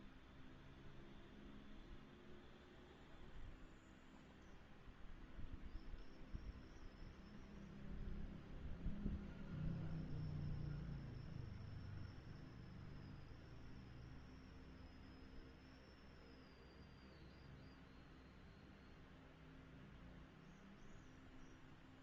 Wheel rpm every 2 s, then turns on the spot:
0, 0, 0, 0, 0, 0, 0, 0, 0, 0, 0.
none